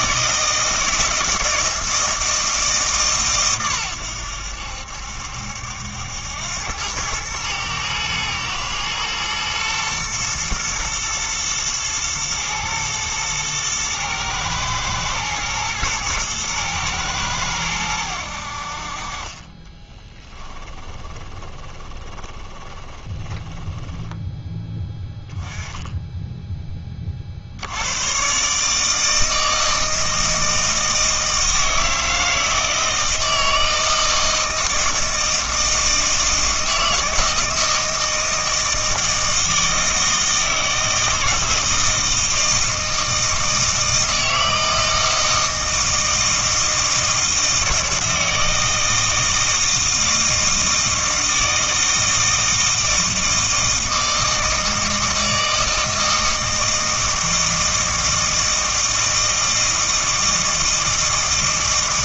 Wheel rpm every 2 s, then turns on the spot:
160, 150, 70, 100, 110, 120, 110, 110, 110, 50, 20, 20, 10, 20, 150, 160, 160, 160, 160, 160, 160, 160, 160, 160, 160, 160, 160, 160, 160, 160, 160.
20-24